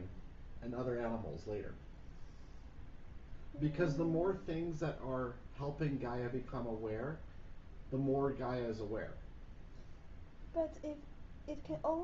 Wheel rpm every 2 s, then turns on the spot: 0, 0, 0, 0, 0, 0.
none